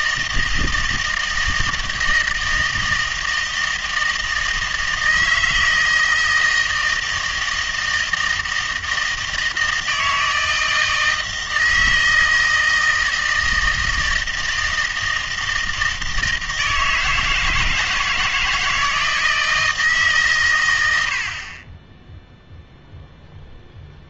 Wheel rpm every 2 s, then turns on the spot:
160, 160, 160, 160, 160, 160, 160, 160, 160, 160, 110, 0.
none